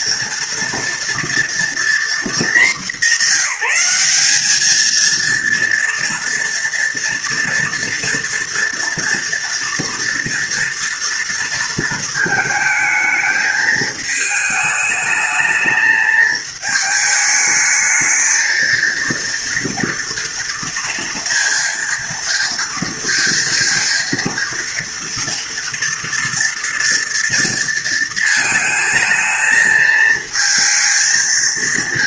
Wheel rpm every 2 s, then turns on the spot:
230, 220, 200, 230, 230, 230, 220, 220, 220, 220, 230, 230, 230, 230, 220, 230.
none